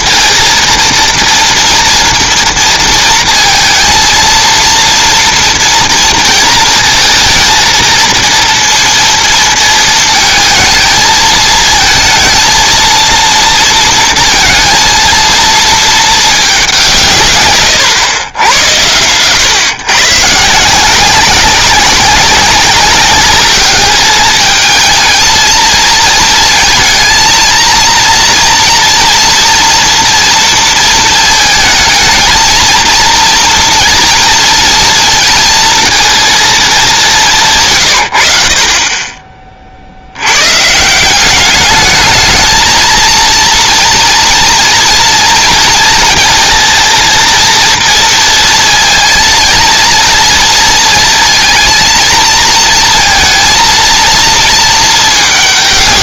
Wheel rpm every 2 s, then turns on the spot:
230, 230, 230, 230, 230, 220, 230, 230, 190, 100, 160, 200, 220, 230, 240, 230, 230, 230, 210, 30, 130, 230, 230, 230, 230, 230, 230, 220.
none